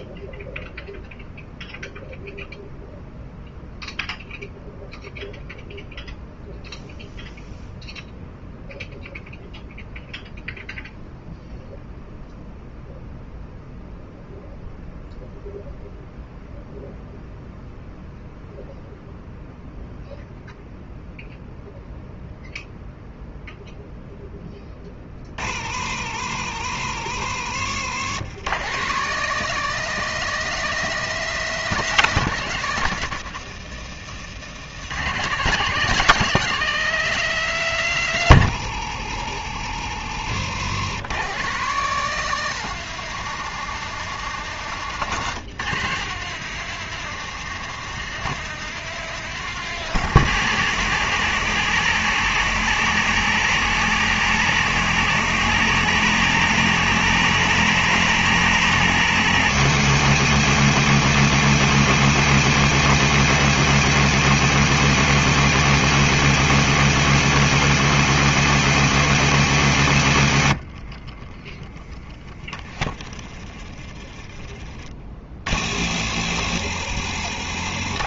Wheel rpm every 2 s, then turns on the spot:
0, 0, 0, 0, 0, 0, 0, 0, 0, 0, 0, 0, 30, 60, 140, 170, 120, 130, 160, 70, 120, 160, 150, 160, 160, 110, 120, 120, 120, 120, 100, 100, 100, 100, 100, 20, 20, 40, 70.
72-74 76-78